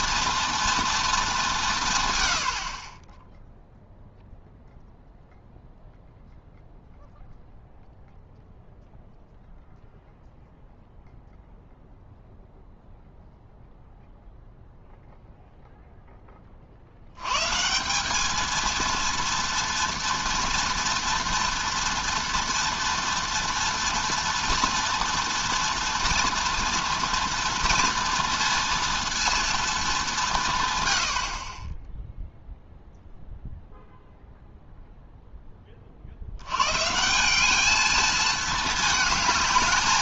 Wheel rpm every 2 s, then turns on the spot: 230, 70, 0, 0, 0, 0, 0, 0, 50, 220, 240, 230, 230, 230, 230, 130, 0, 0, 120, 220.
none